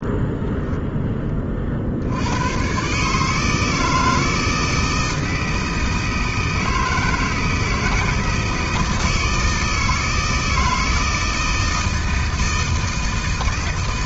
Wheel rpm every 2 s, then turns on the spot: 10, 140, 160, 160, 160, 160, 160.
none